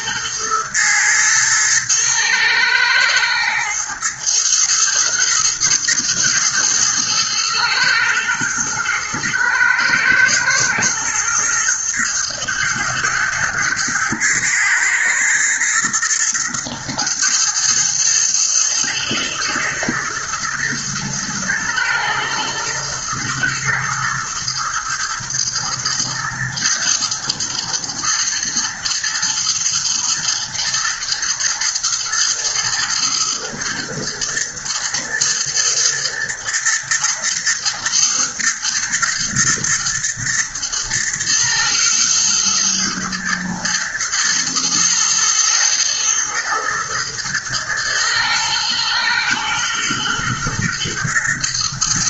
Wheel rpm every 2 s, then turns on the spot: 110, 110, 110, 110, 120, 110, 120, 120, 110, 110, 110, 110, 110, 110, 120, 120, 120, 120, 120, 120, 110, 120, 110, 120, 120, 120.
none